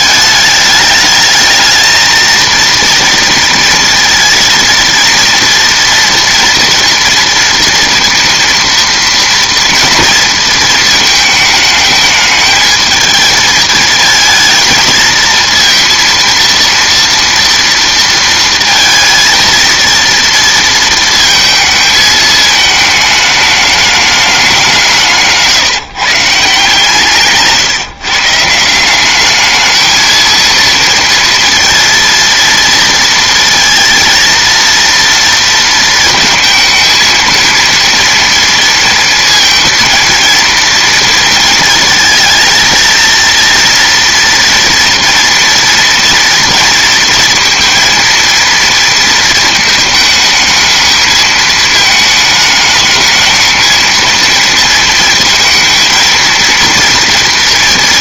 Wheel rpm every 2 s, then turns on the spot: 210, 230, 230, 240, 230, 220, 220, 230, 230, 230, 230, 220, 190, 150, 160, 230, 230, 230, 230, 230, 230, 230, 230, 230, 230, 220, 220, 230, 230.
none